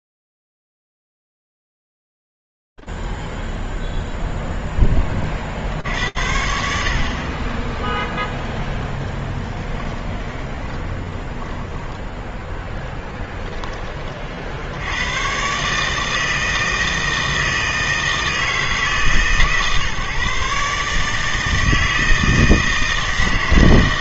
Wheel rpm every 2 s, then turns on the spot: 0, 0, 0, 60, 10, 10, 10, 30, 160, 160, 140, 160.
10-12